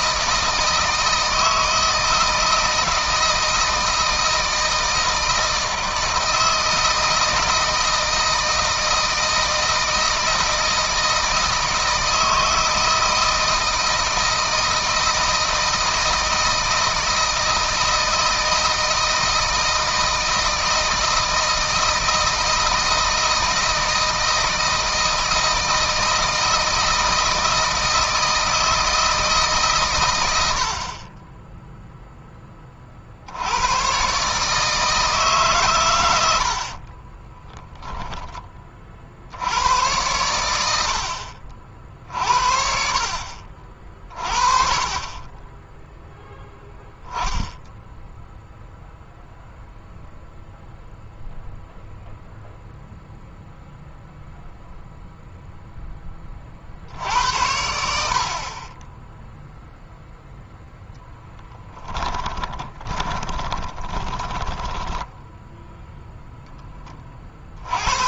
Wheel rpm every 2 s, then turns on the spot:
160, 160, 160, 160, 160, 160, 160, 160, 160, 160, 160, 160, 160, 160, 160, 70, 30, 150, 60, 40, 100, 60, 40, 10, 0, 0, 0, 0, 50, 30, 0, 20, 10, 20.
36-38 62-66